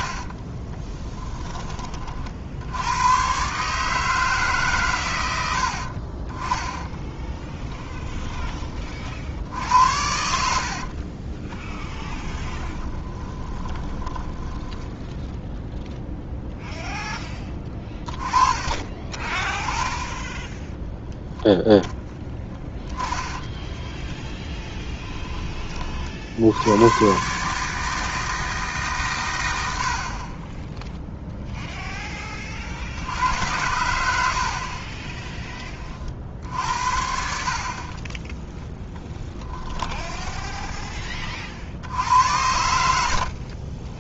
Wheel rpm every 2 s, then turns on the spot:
20, 80, 140, 20, 30, 70, 20, 10, 0, 20, 10, 10, 10, 90, 150, 10, 40, 50, 70, 10, 10, 80.
0-2 10-16 24-26 42-44